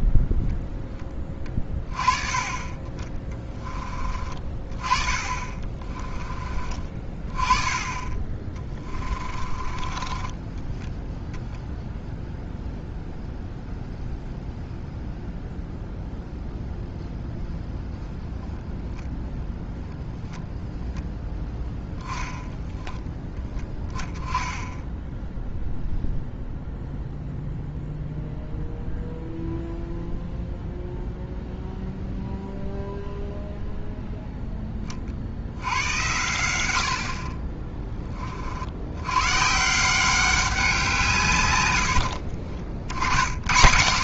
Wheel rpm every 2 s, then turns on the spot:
10, 30, 30, 20, 20, 10, 0, 0, 0, 0, 0, 10, 10, 0, 0, 0, 0, 10, 90, 60, 190, 50.
8-12 22-24 42-44